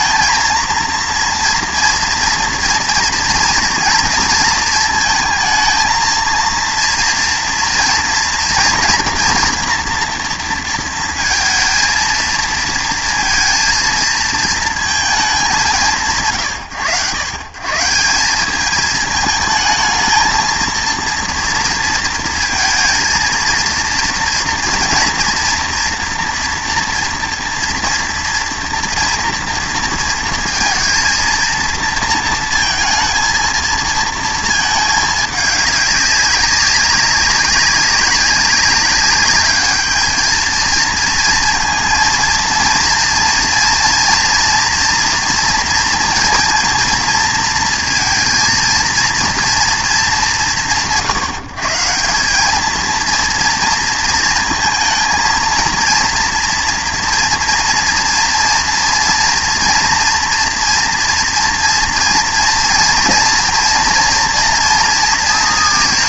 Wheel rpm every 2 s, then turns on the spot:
230, 230, 230, 230, 230, 230, 230, 230, 100, 200, 230, 230, 230, 230, 230, 230, 230, 220, 200, 200, 220, 230, 240, 240, 230, 130, 210, 220, 230, 230, 230, 230, 230.
none